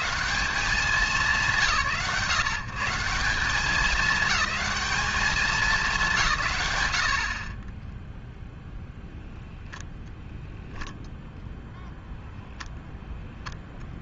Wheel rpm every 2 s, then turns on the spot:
160, 120, 210, 120, 0, 0, 0.
none